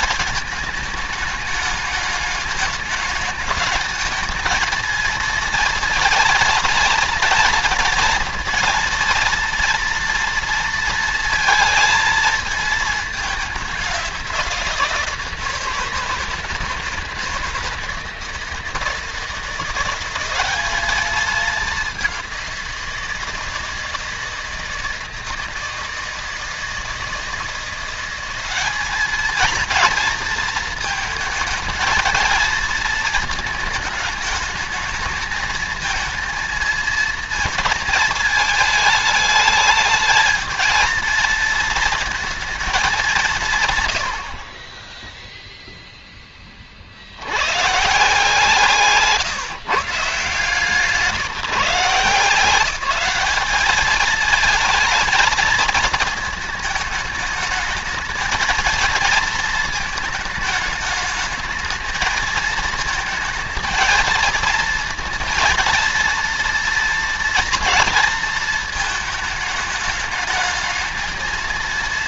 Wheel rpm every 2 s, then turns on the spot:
220, 210, 230, 230, 230, 230, 210, 170, 160, 170, 210, 170, 160, 160, 210, 220, 220, 220, 220, 210, 230, 190, 10, 80, 160, 160, 200, 230, 210, 230, 220, 220, 230, 230, 220, 220.
none